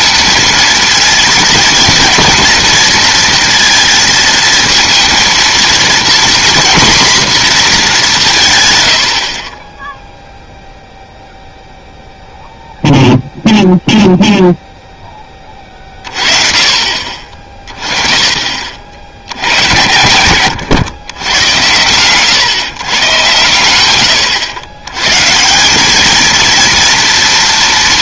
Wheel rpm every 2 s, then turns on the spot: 240, 230, 230, 240, 70, 0, 0, 0, 30, 50, 110, 130, 110, 230.
none